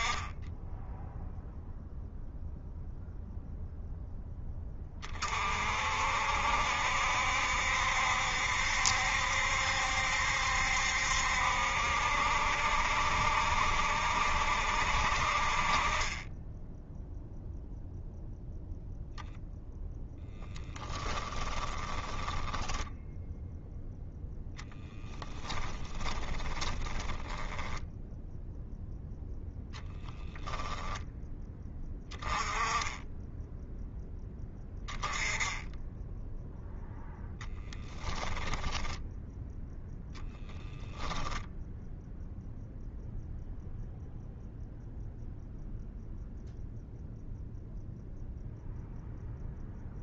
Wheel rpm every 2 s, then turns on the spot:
10, 0, 10, 60, 70, 70, 70, 60, 10, 0, 10, 20, 0, 10, 0, 0, 10, 10, 10, 10, 10, 0, 0, 0, 0.
16-18 20-24 26-28 38-42